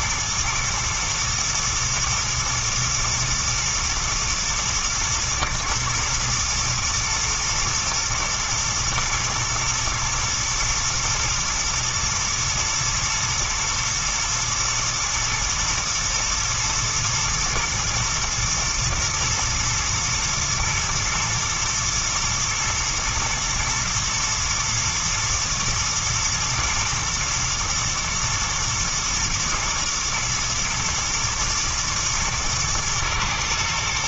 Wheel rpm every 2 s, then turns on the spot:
120, 110, 120, 110, 110, 120, 110, 110, 110, 110, 110, 110, 120, 120, 120, 120, 120.
none